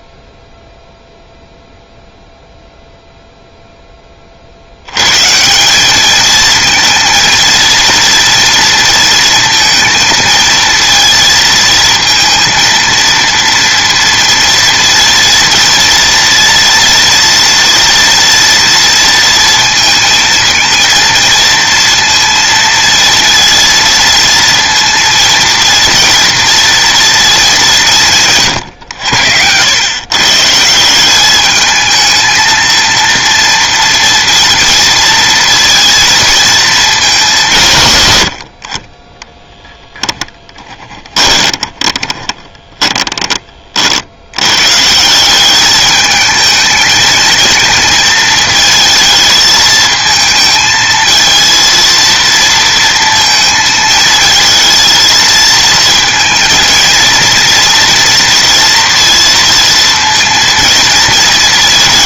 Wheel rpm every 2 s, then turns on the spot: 0, 0, 100, 230, 230, 230, 230, 230, 230, 230, 230, 230, 230, 230, 100, 170, 230, 230, 220, 30, 10, 20, 140, 220, 220, 220, 230, 220, 230, 230, 230.
40-44